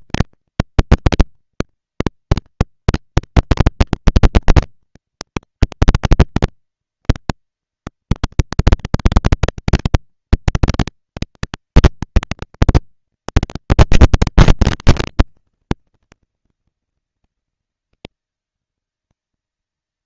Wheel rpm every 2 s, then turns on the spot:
230, 230, 230, 230, 230, 230, 230, 210, 190, 200.
none